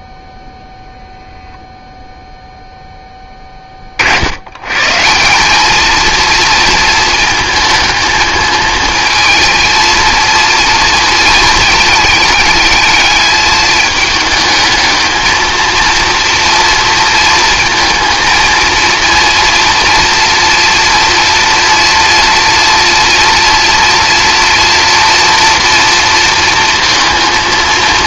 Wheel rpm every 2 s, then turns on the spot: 0, 0, 120, 230, 220, 230, 210, 220, 230, 230, 230, 230, 230, 230.
none